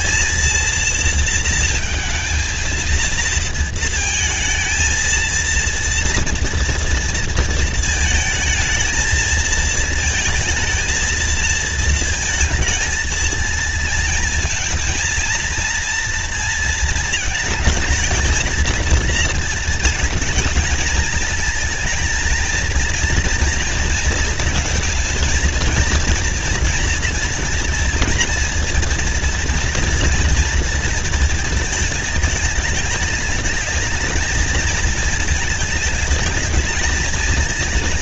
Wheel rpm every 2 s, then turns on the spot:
230, 220, 220, 230, 220, 220, 220, 220, 230, 220, 220, 230, 230, 240, 230, 230, 220, 220, 210.
none